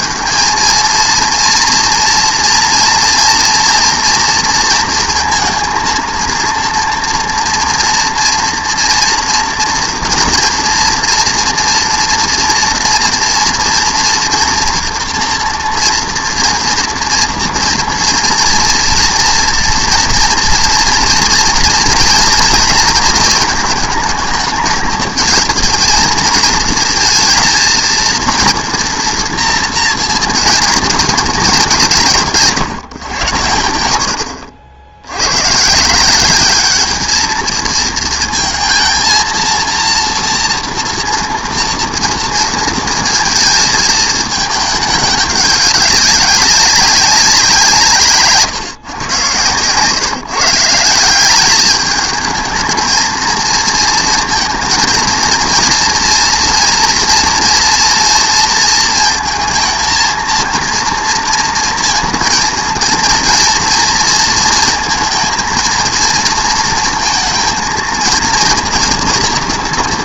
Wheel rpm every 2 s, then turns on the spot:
220, 240, 230, 230, 230, 230, 230, 240, 230, 230, 230, 220, 220, 220, 230, 220, 160, 80, 200, 230, 230, 230, 220, 200, 130, 170, 220, 230, 240, 230, 230, 230, 230, 230, 230.
none